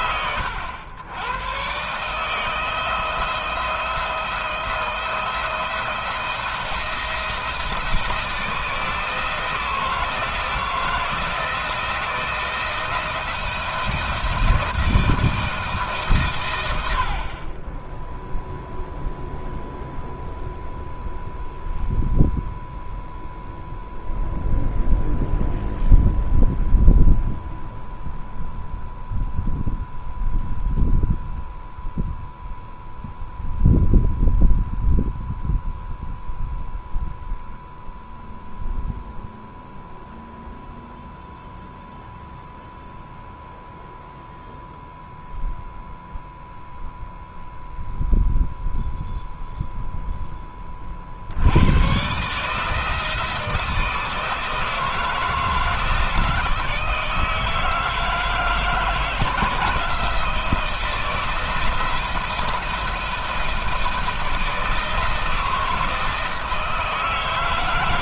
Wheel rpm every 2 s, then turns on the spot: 100, 160, 170, 170, 160, 170, 170, 160, 100, 0, 0, 0, 0, 0, 0, 0, 0, 0, 0, 0, 0, 0, 0, 0, 0, 40, 160, 160, 160, 160, 160, 170, 160, 160.
none